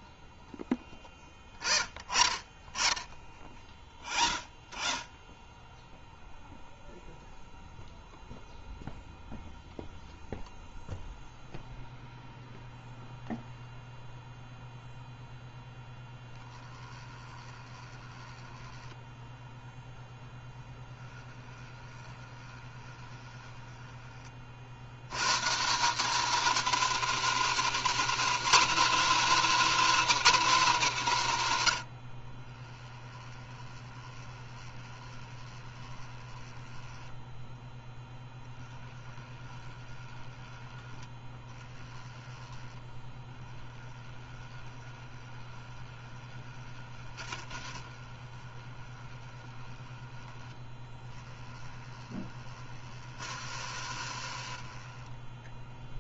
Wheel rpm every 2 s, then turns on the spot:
0, 0, 0, 0, 0, 0, 0, 0, 10, 10, 10, 20, 80, 230, 310, 230, 20, 20, 10, 20, 10, 10, 20, 30, 20, 10, 40, 30.
16-24 32-40 42-56